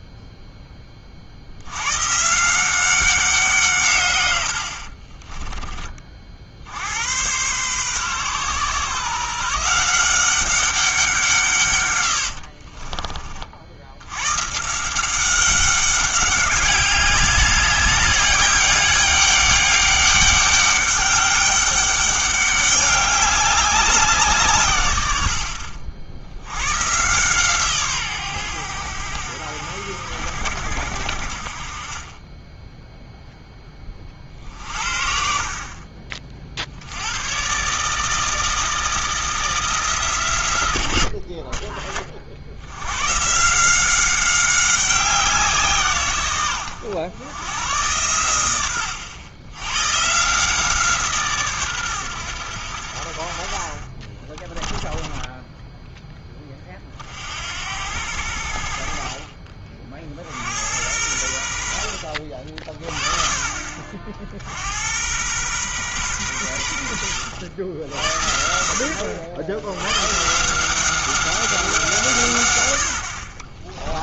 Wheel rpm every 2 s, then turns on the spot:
20, 170, 70, 70, 130, 190, 50, 150, 190, 200, 200, 200, 130, 110, 100, 70, 10, 50, 60, 160, 100, 80, 190, 110, 90, 160, 80, 10, 30, 60, 80, 40, 80, 90, 70, 170, 90.
12-14 54-56